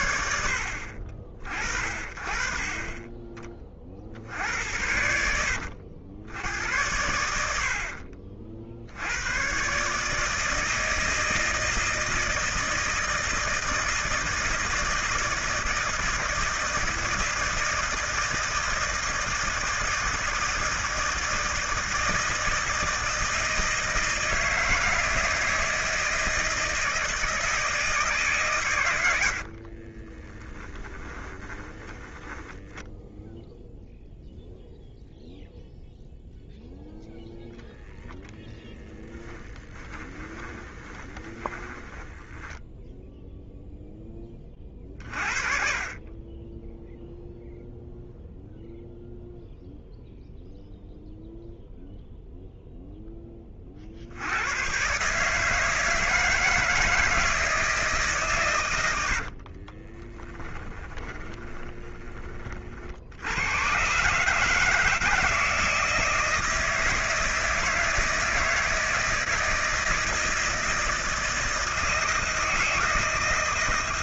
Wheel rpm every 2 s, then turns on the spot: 50, 30, 80, 70, 80, 160, 160, 160, 160, 160, 160, 160, 160, 160, 90, 20, 10, 0, 0, 10, 20, 0, 40, 0, 0, 0, 10, 130, 160, 90, 20, 60, 160, 160, 160, 160, 160.
30-34 38-42 58-62